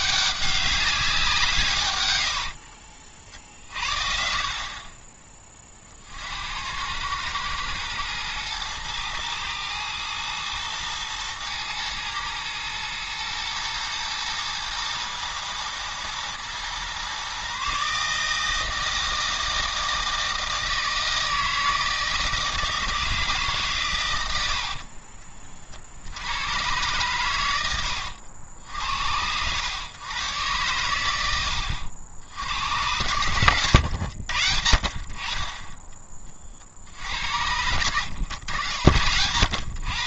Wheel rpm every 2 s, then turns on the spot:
200, 50, 40, 80, 110, 120, 110, 120, 120, 160, 160, 160, 60, 110, 80, 120, 90, 70, 50, 70.
2-4 24-26 32-34